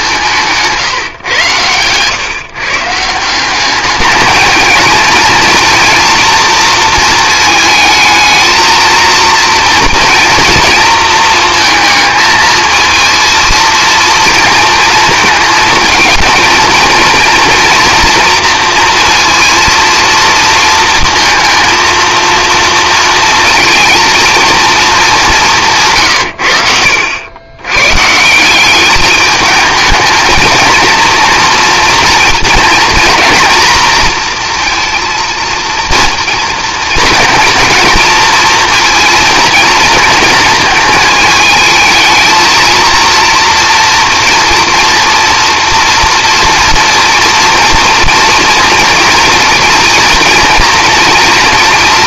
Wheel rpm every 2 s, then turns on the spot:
160, 150, 220, 230, 220, 230, 220, 230, 230, 230, 230, 230, 230, 70, 190, 230, 230, 230, 230, 230, 220, 230, 240, 230, 230, 230.
0-2